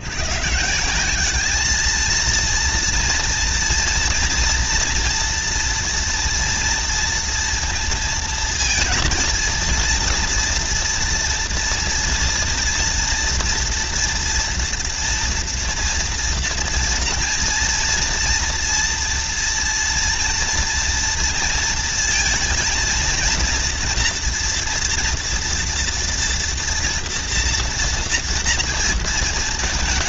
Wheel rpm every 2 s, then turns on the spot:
150, 230, 240, 230, 230, 240, 230, 230, 230, 230, 230, 230, 240, 230, 230.
none